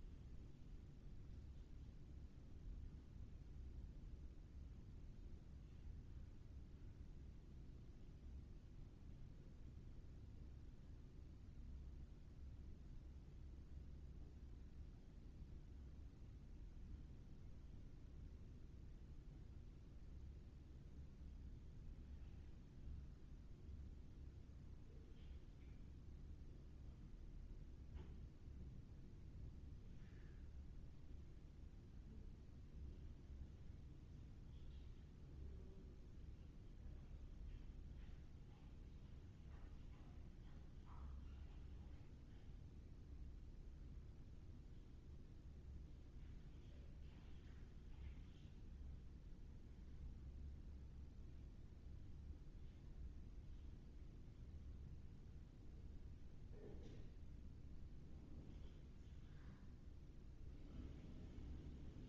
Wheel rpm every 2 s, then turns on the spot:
0, 0, 0, 0, 0, 0, 0, 0, 0, 0, 0, 0, 0, 0, 0, 0, 0, 0, 0, 0, 0, 0, 0, 0, 0, 0, 0, 0, 0, 0, 0.
none